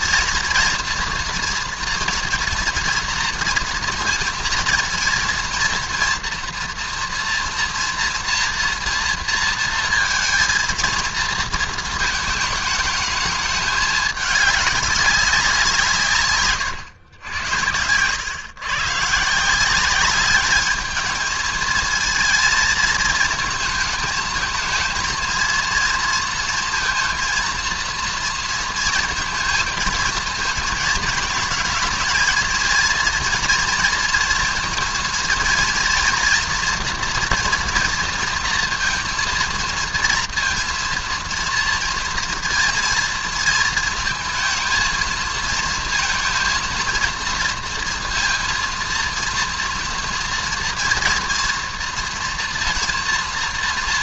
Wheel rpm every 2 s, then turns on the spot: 230, 230, 230, 230, 230, 230, 210, 200, 110, 130, 210, 230, 220, 230, 230, 220, 230, 230, 230, 230, 230, 230, 220, 230, 230, 230, 230.
none